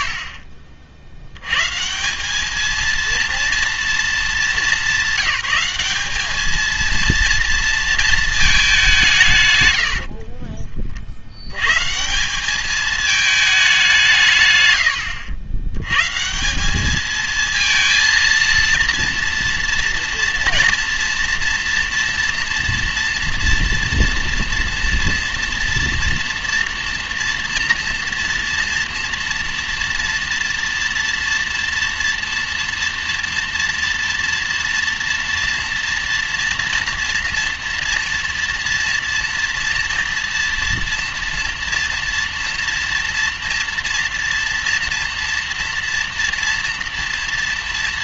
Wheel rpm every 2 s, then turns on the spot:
70, 220, 210, 230, 200, 30, 210, 100, 200, 230, 240, 230, 230, 230, 230, 230, 230, 230, 230, 240, 230, 230, 230, 230.
none